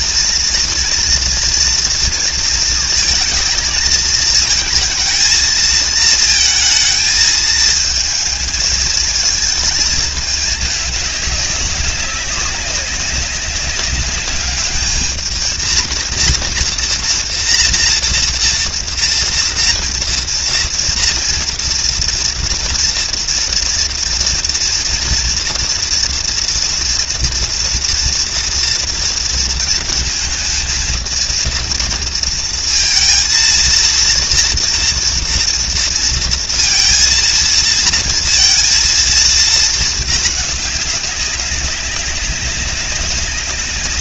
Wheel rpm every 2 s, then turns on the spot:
230, 230, 220, 220, 220, 210, 200, 210, 230, 230, 230, 230, 230, 230, 230, 220, 230, 240, 230, 230, 200, 190.
none